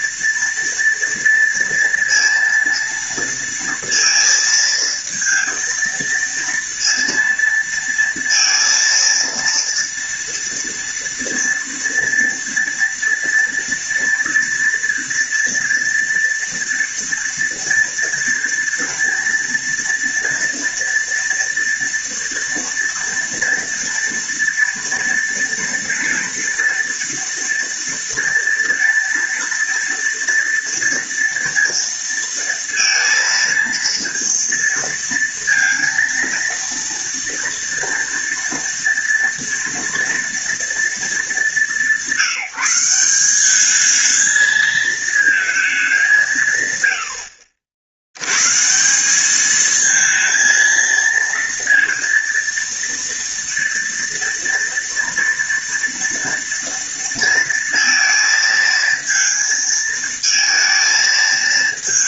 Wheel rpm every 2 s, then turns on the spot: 230, 230, 230, 230, 230, 230, 230, 230, 230, 230, 230, 230, 230, 230, 230, 230, 230, 230, 230, 230, 220, 180, 220, 130, 150, 230, 230, 230, 230, 230, 230.
none